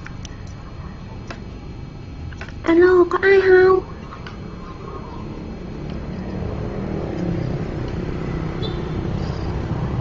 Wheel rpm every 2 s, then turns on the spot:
0, 0, 0, 0, 0.
none